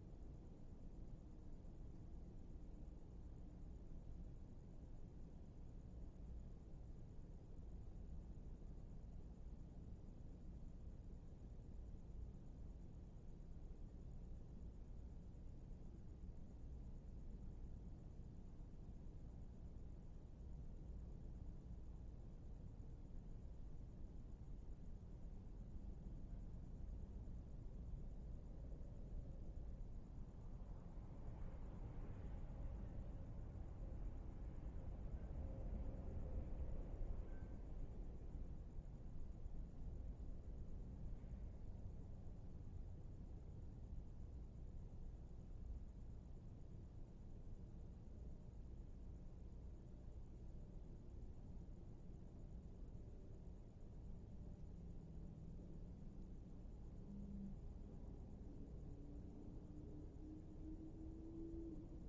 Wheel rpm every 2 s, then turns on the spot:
0, 0, 0, 0, 0, 0, 0, 0, 0, 0, 0, 0, 0, 0, 0, 0, 0, 0, 0, 0, 0, 0, 0, 0, 0, 0, 0, 0, 0, 0, 0.
none